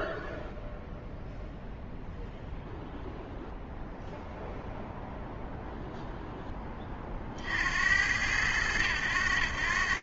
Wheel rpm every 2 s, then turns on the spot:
0, 0, 0, 50, 90.
none